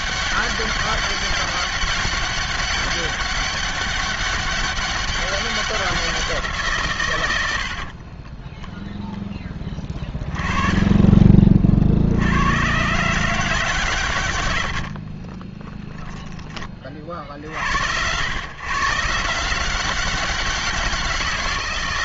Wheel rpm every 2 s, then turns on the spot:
200, 200, 200, 150, 0, 20, 110, 90, 40, 130, 190.
10-12